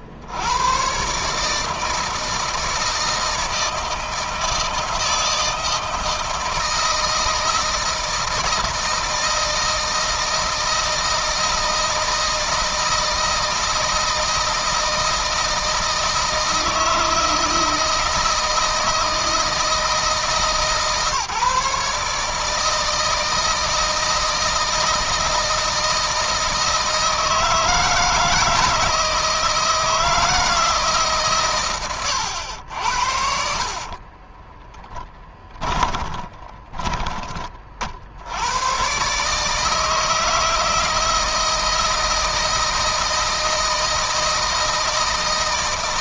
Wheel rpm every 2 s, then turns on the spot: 100, 160, 160, 160, 160, 160, 160, 160, 160, 160, 150, 160, 160, 160, 160, 160, 80, 10, 20, 110, 160, 160, 160.
34-38